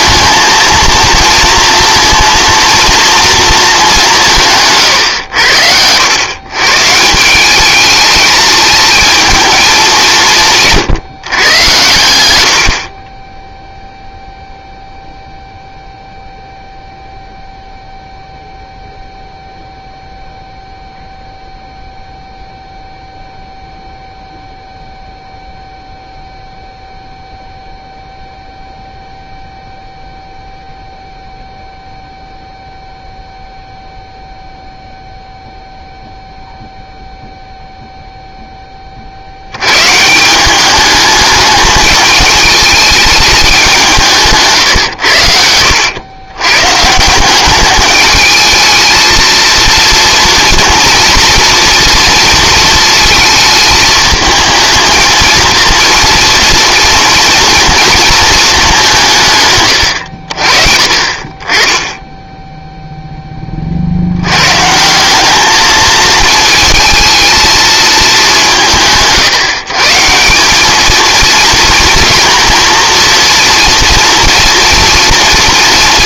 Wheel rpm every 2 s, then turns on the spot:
230, 230, 140, 150, 220, 140, 60, 0, 0, 0, 0, 0, 0, 0, 0, 0, 0, 0, 0, 20, 200, 210, 130, 130, 220, 230, 230, 230, 230, 200, 50, 0, 150, 220, 180, 210, 240, 230.
none